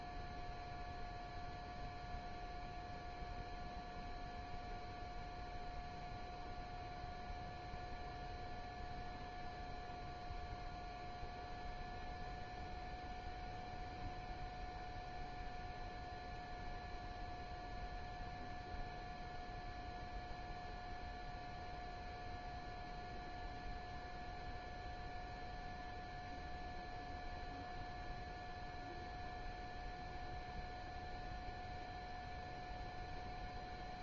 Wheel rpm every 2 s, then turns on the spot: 0, 0, 0, 0, 0, 0, 0, 0, 0, 0, 0, 0, 0, 0, 0, 0, 0.
none